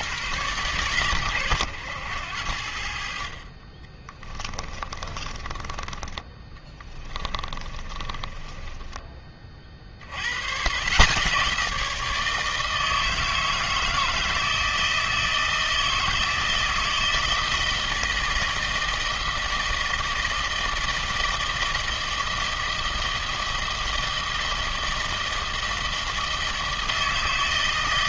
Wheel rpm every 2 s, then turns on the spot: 130, 70, 30, 20, 10, 140, 160, 160, 160, 160, 160, 160, 160, 160.
4-8